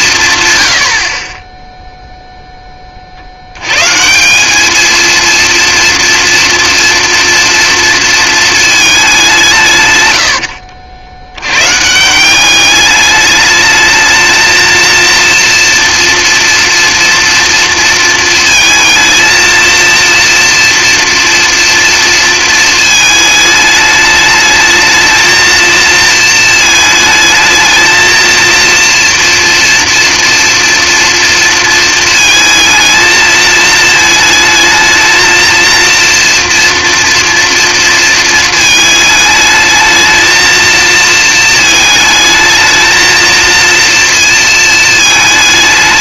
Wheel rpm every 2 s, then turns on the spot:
140, 10, 210, 230, 220, 80, 200, 220, 230, 230, 230, 230, 220, 220, 230, 230, 220, 220, 240, 220, 220, 220, 220.
10-12